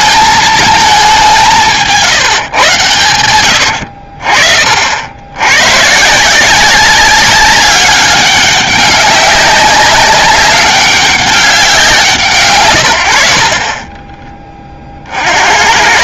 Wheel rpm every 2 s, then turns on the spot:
220, 130, 50, 190, 200, 200, 120, 30.
none